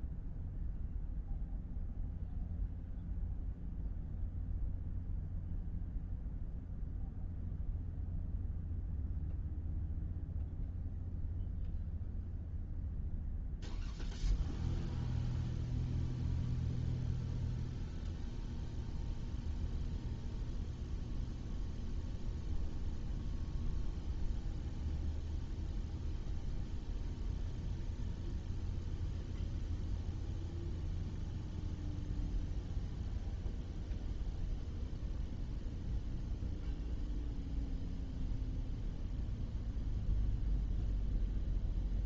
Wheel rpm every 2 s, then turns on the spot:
0, 0, 0, 0, 0, 0, 0, 0, 0, 0, 0, 0, 0, 0, 0, 0, 0, 0, 0, 0, 0.
none